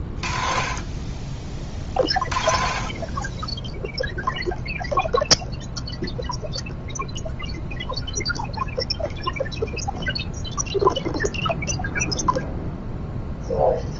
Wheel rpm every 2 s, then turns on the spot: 20, 40, 0, 0, 0, 0, 0.
none